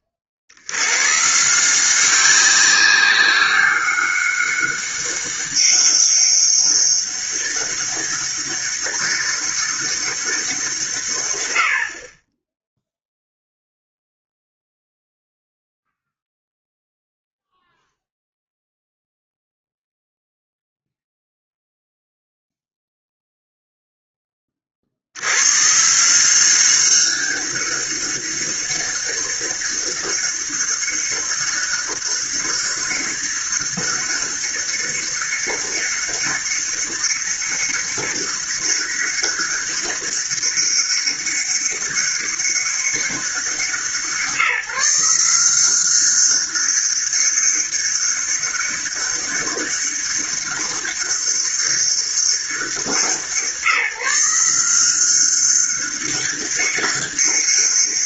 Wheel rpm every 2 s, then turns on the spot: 50, 190, 200, 200, 200, 170, 10, 0, 0, 0, 0, 0, 30, 180, 190, 200, 200, 200, 200, 200, 200, 200, 160, 200, 200, 200, 190, 180, 200.
none